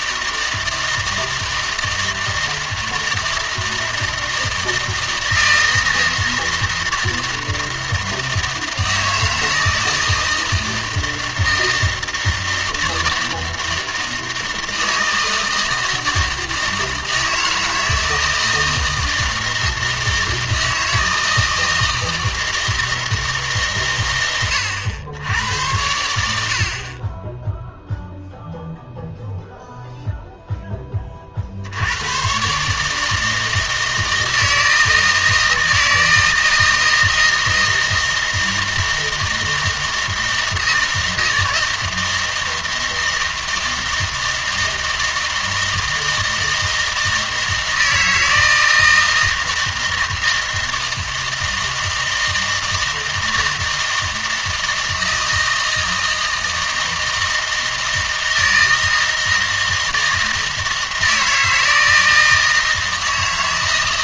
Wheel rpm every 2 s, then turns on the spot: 160, 160, 160, 160, 160, 160, 160, 160, 160, 160, 160, 160, 100, 50, 0, 10, 140, 160, 160, 160, 160, 160, 160, 160, 160, 160, 160, 160, 160, 160, 160, 160.
none